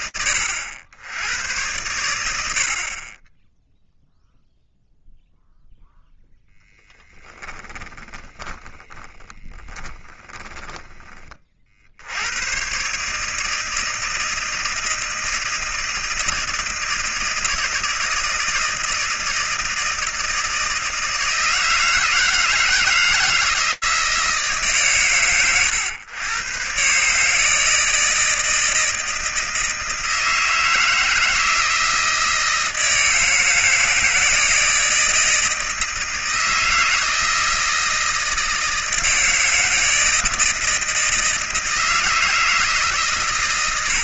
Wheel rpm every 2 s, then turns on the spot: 90, 40, 0, 20, 30, 30, 140, 160, 160, 160, 160, 160, 130, 140, 160, 160, 160, 160, 160, 160, 160, 150.
6-10